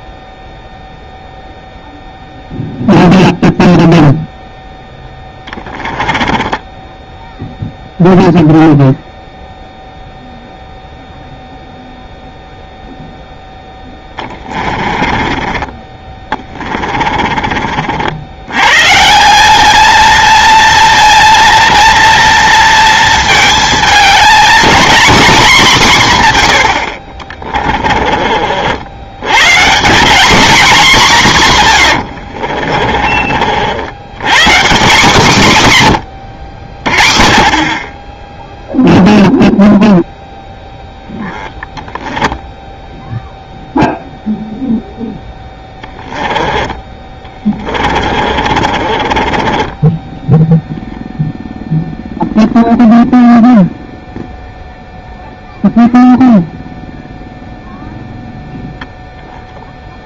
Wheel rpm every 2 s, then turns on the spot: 0, 0, 0, 20, 0, 0, 0, 20, 30, 130, 230, 230, 250, 80, 60, 230, 40, 180, 80, 0, 10, 10, 0, 20, 40, 0, 0, 0, 0, 0.
6-8 14-18 32-34 46-50